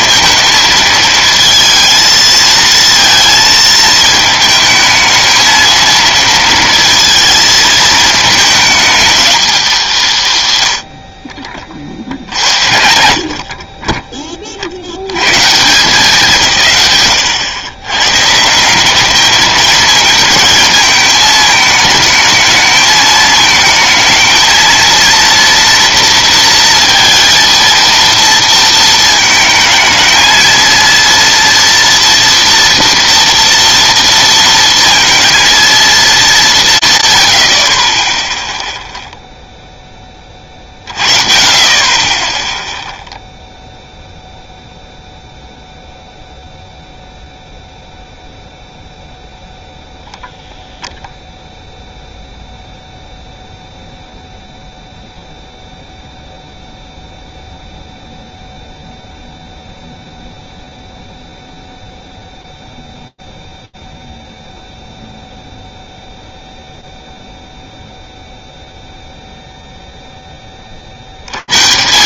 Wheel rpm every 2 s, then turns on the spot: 220, 230, 220, 220, 200, 30, 40, 120, 100, 210, 210, 220, 230, 230, 220, 230, 230, 230, 90, 0, 40, 0, 0, 0, 0, 0, 0, 0, 0, 0, 0, 0, 0, 0, 0, 170.
none